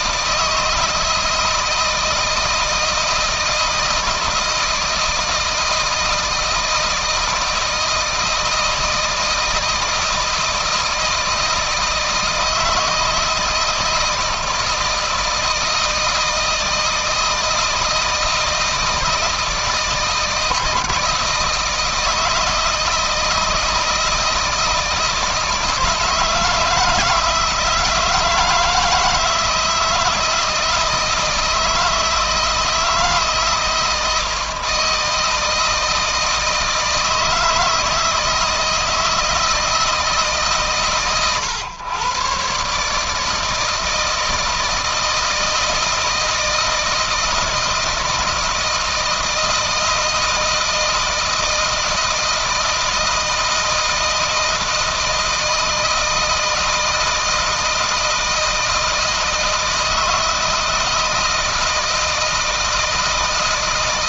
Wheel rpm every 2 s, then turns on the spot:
160, 160, 160, 160, 160, 160, 160, 160, 160, 160, 160, 160, 160, 160, 160, 160, 160, 160, 160, 160, 120, 140, 160, 160, 160, 160, 160, 160, 160, 160, 160, 160.
none